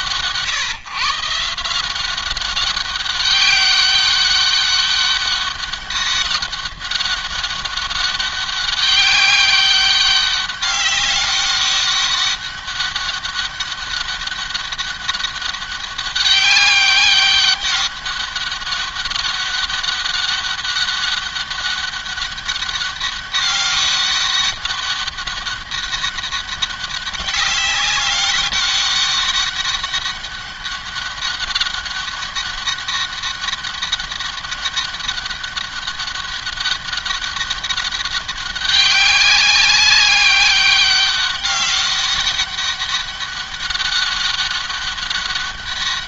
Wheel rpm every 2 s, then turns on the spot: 140, 190, 200, 200, 200, 200, 200, 190, 190, 200, 200, 200, 200, 200, 200, 200, 200, 200, 200, 190, 200, 200, 200.
none